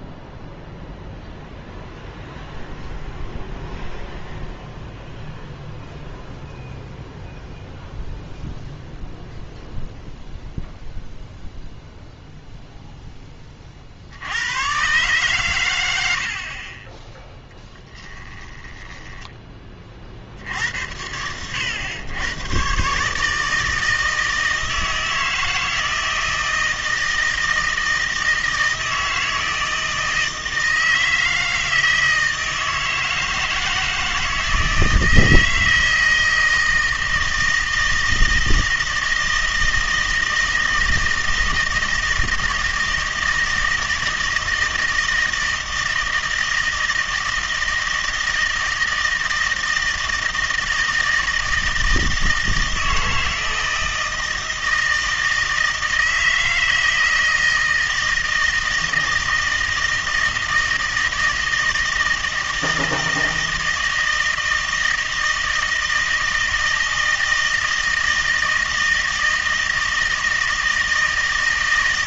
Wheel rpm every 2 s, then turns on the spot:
0, 0, 0, 0, 0, 0, 0, 110, 50, 10, 70, 120, 160, 160, 160, 160, 160, 160, 160, 160, 160, 160, 160, 160, 160, 160, 160, 160, 160, 160, 160, 160, 160, 160, 160, 160.
18-20